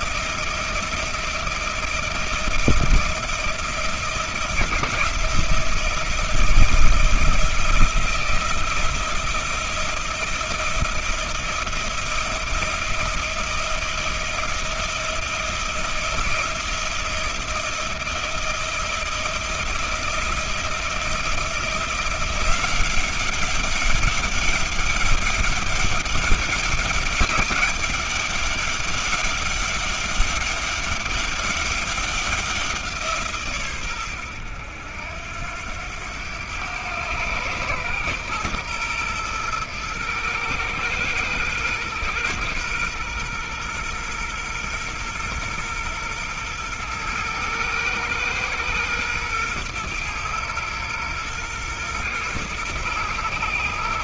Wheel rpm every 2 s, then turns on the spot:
170, 170, 160, 160, 160, 170, 170, 170, 170, 170, 170, 180, 200, 200, 200, 200, 180, 90, 100, 120, 110, 120, 120, 120, 110, 110, 110.
none